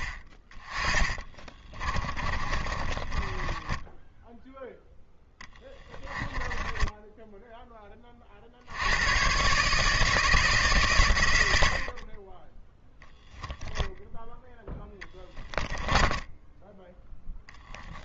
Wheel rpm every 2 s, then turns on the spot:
20, 30, 0, 10, 70, 140, 10, 10, 10.
2-4 14-16